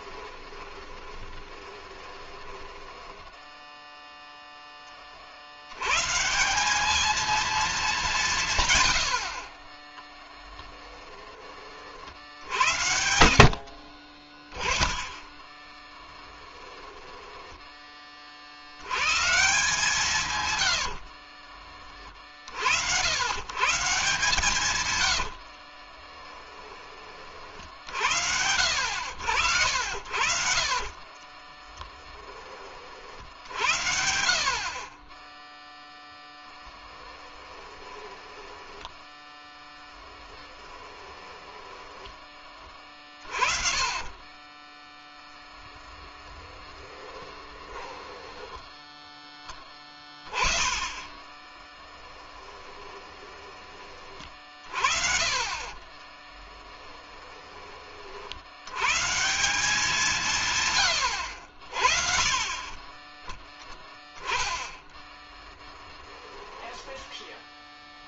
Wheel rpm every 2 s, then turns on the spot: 20, 10, 30, 200, 110, 10, 70, 10, 10, 100, 80, 90, 110, 30, 80, 40, 50, 30, 10, 10, 10, 30, 10, 20, 20, 30, 20, 50, 10, 130, 100, 20, 10, 10.
0-4 10-14 16-18 20-22 24-26 30-32 36-44 46-48 50-54 56-58 66-68